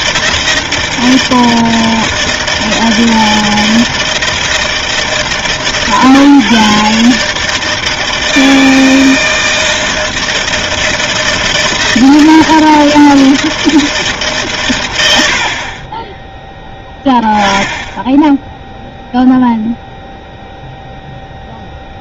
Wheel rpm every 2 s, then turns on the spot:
160, 160, 160, 140, 160, 160, 160, 110, 10, 0, 0.
none